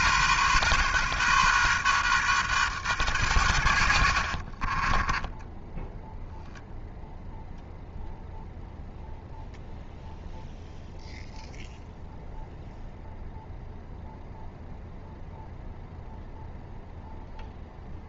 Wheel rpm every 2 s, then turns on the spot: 130, 120, 30, 0, 0, 0, 0, 0, 0.
4-6